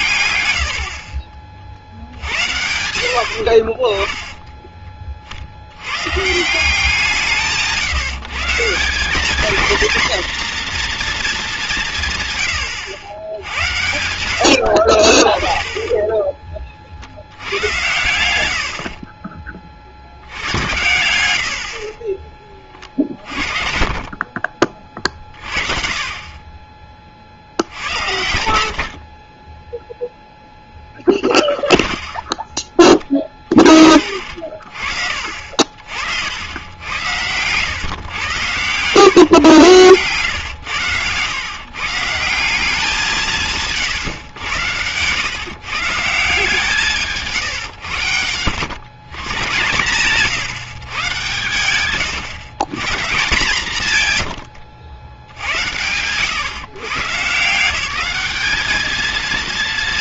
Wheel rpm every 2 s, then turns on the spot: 80, 70, 20, 160, 160, 240, 120, 80, 40, 70, 100, 30, 40, 30, 70, 10, 20, 40, 80, 120, 110, 180, 110, 160, 100, 150, 130, 100, 130, 210.
14-16 34-36 40-42 54-56